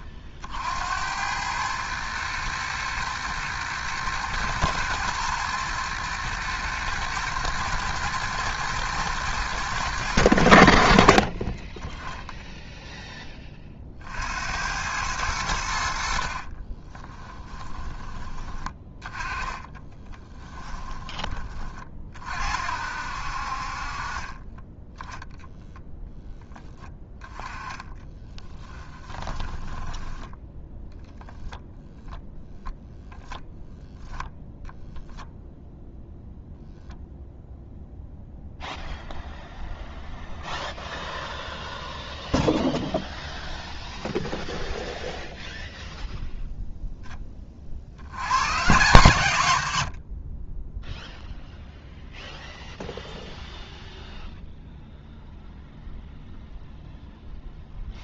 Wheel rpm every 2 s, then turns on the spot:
60, 110, 120, 110, 110, 80, 0, 80, 30, 20, 10, 60, 20, 10, 20, 0, 0, 0, 0, 0, 0, 0, 0, 0, 130, 20, 0, 0, 0.
16-22 28-30